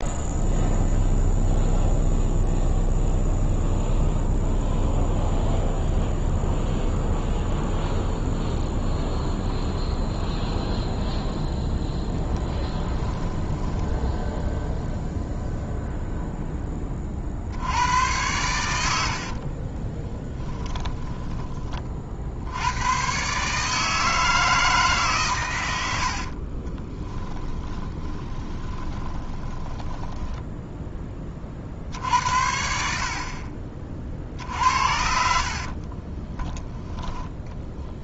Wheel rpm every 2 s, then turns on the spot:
0, 0, 0, 0, 0, 0, 20, 0, 20, 100, 20, 90, 160, 30, 20, 10, 60, 70, 10.
12-14 20-22 26-30